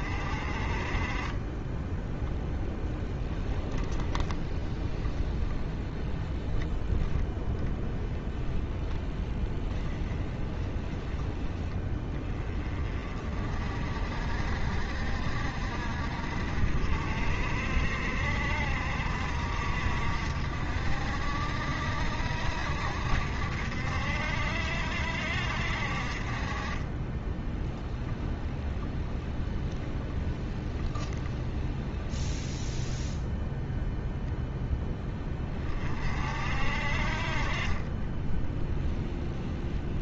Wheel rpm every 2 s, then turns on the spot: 30, 10, 20, 10, 10, 10, 30, 50, 50, 50, 60, 60, 60, 30, 10, 10, 0, 10, 50, 10.
2-6 8-10 26-32 38-40